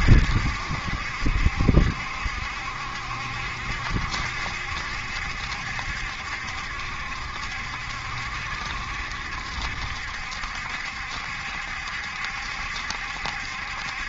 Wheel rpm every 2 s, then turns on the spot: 80, 70, 70, 70, 70, 70, 70.
none